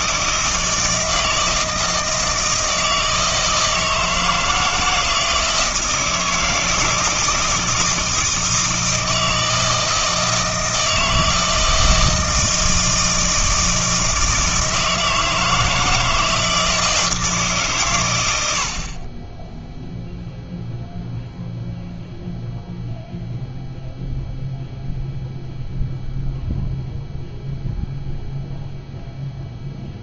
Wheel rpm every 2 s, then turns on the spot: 160, 160, 160, 160, 160, 160, 160, 160, 160, 70, 0, 0, 0, 0, 0.
none